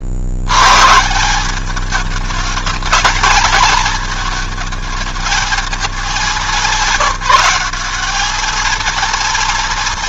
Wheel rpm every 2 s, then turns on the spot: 120, 220, 220, 200, 230.
none